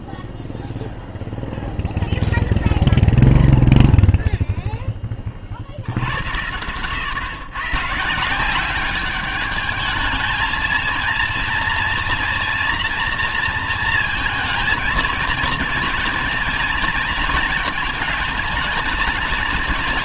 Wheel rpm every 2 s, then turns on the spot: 0, 0, 0, 90, 180, 220, 230, 230, 230, 220.
none